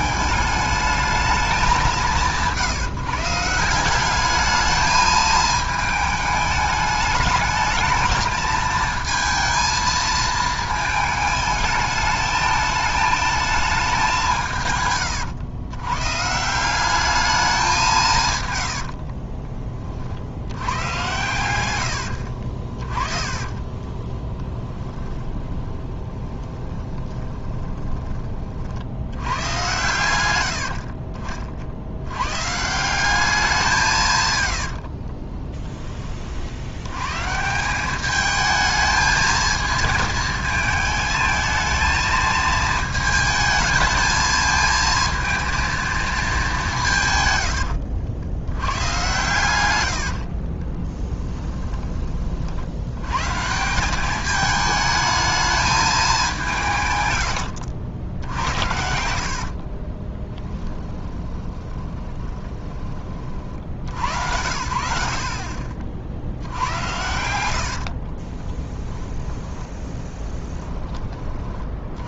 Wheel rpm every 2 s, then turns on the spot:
210, 160, 210, 210, 220, 220, 220, 140, 190, 80, 100, 40, 10, 20, 70, 50, 170, 70, 90, 220, 220, 220, 220, 170, 100, 30, 80, 220, 150, 70, 10, 20, 70, 80, 10, 10.
18-20 22-28 30-32 34-36 50-52 58-62 66-70